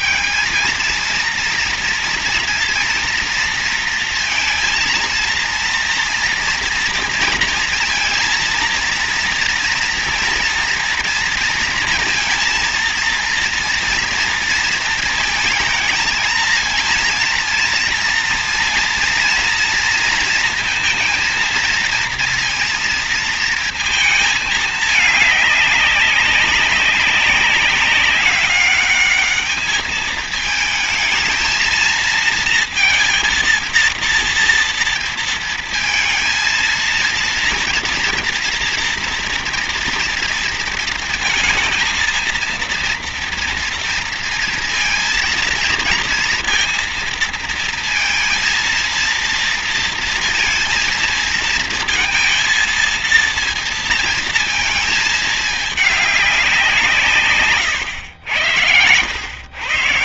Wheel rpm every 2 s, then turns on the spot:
220, 230, 230, 230, 230, 240, 230, 230, 230, 230, 230, 230, 220, 200, 200, 220, 230, 230, 230, 230, 230, 230, 230, 230, 230, 230, 230, 220, 190, 100.
none